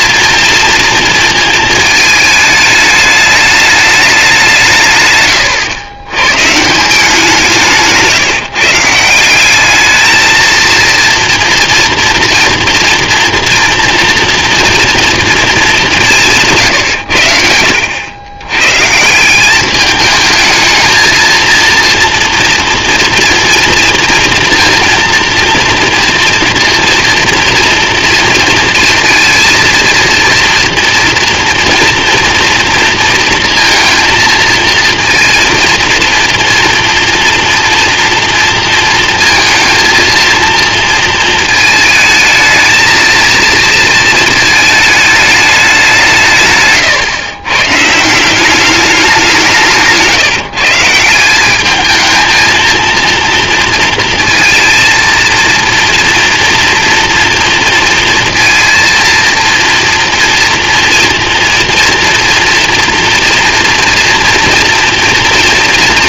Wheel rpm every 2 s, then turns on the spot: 230, 210, 150, 160, 160, 230, 230, 230, 130, 140, 220, 230, 230, 230, 230, 240, 230, 230, 240, 230, 230, 230, 220, 140, 200, 160, 230, 230, 230, 230, 230, 230, 230.
46-48